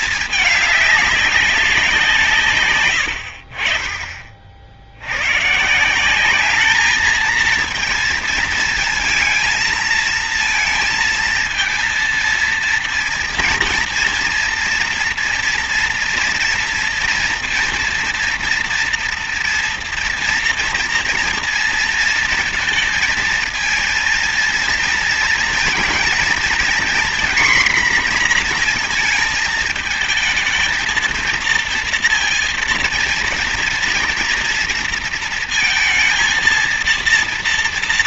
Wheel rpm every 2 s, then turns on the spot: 220, 160, 40, 200, 230, 230, 230, 230, 230, 240, 240, 230, 230, 230, 240, 220, 230, 230, 230.
none